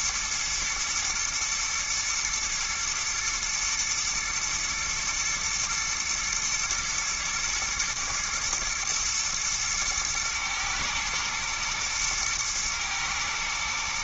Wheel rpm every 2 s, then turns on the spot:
110, 120, 110, 120, 110, 110, 110.
none